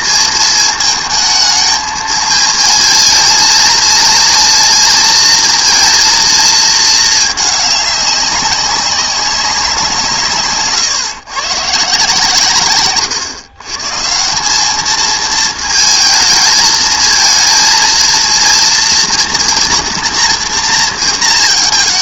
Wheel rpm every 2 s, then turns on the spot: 220, 220, 230, 220, 200, 140, 130, 200, 220, 230, 230.
10-12